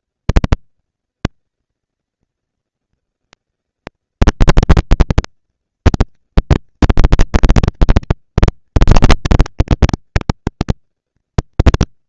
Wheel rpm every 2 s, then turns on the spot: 200, 230, 230, 230, 230, 240.
none